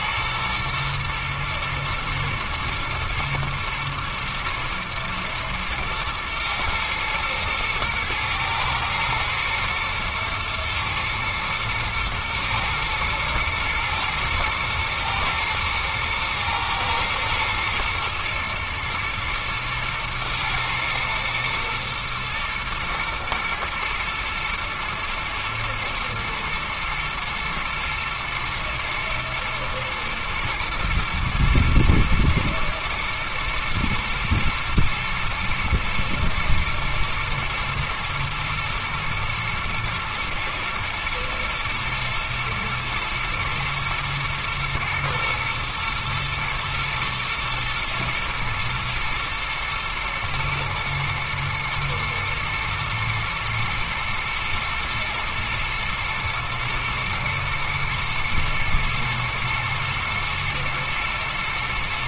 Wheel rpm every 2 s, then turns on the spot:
120, 110, 110, 110, 110, 110, 120, 110, 110, 120, 110, 120, 120, 120, 120, 110, 120, 110, 120, 120, 110, 110, 120, 110, 120, 110, 110, 110, 110, 120, 120.
none